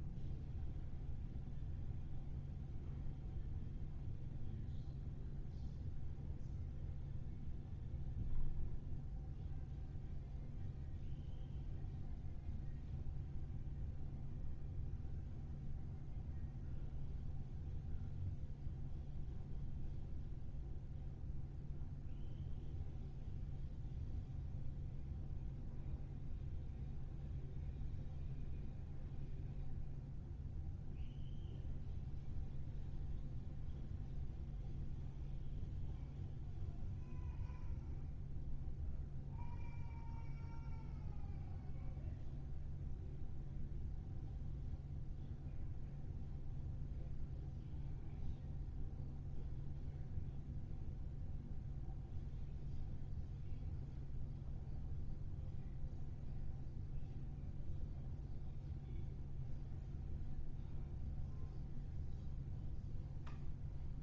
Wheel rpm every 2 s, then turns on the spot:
0, 0, 0, 0, 0, 0, 0, 0, 0, 0, 0, 0, 0, 0, 0, 0, 0, 0, 0, 0, 0, 0, 0, 0, 0, 0, 0, 0, 0, 0, 0, 0.
none